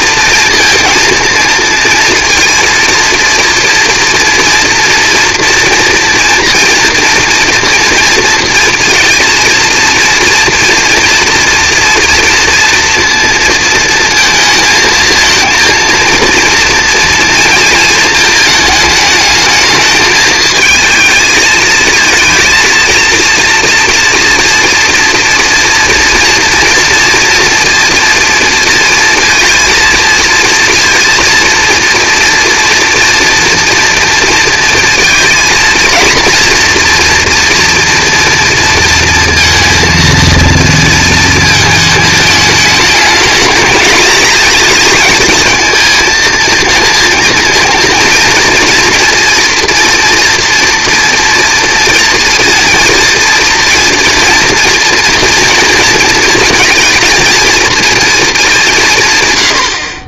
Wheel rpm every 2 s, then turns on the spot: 230, 230, 230, 230, 230, 240, 230, 220, 230, 220, 220, 230, 230, 230, 230, 230, 230, 230, 240, 230, 230, 220, 230, 230, 230, 240, 230, 230, 230, 180.
none